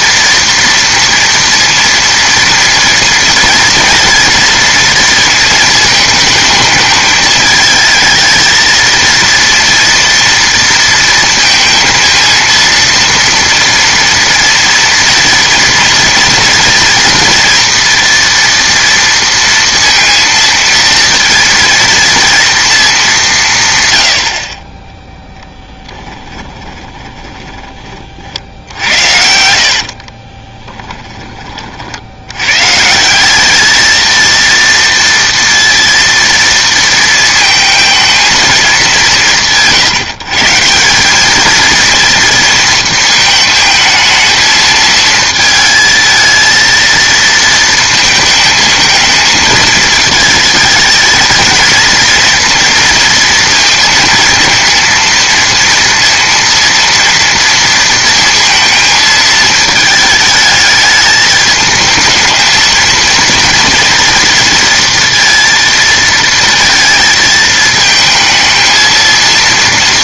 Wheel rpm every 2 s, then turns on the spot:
230, 230, 230, 220, 230, 230, 230, 230, 230, 230, 230, 220, 20, 20, 60, 20, 130, 230, 230, 200, 160, 230, 220, 230, 220, 220, 230, 230, 230, 230, 210, 220, 230, 220, 220.
26-28 30-32